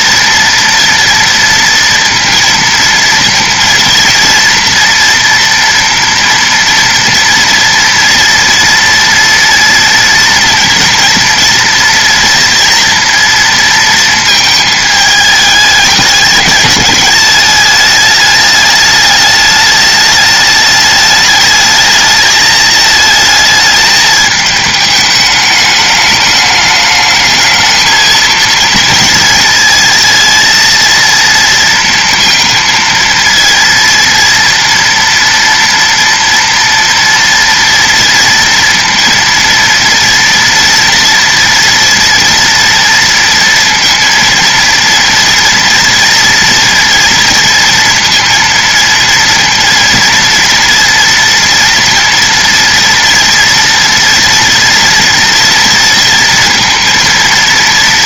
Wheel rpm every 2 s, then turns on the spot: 230, 230, 230, 230, 230, 230, 230, 220, 200, 210, 210, 220, 210, 210, 220, 230, 230, 230, 230, 230, 230, 230, 230, 230, 230, 230, 230, 230, 230.
none